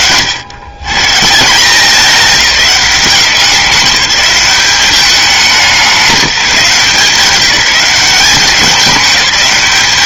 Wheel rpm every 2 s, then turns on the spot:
130, 200, 200, 180, 200.
none